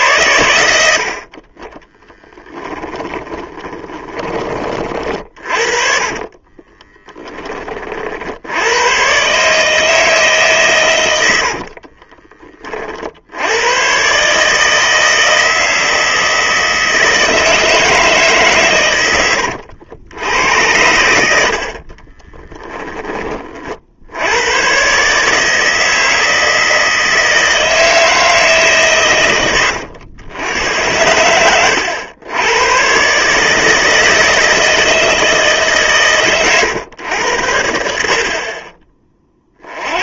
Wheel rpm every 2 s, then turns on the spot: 70, 20, 40, 20, 120, 110, 50, 160, 160, 110, 90, 20, 130, 160, 130, 90, 120, 160, 120, 30.
2-4 6-8 10-12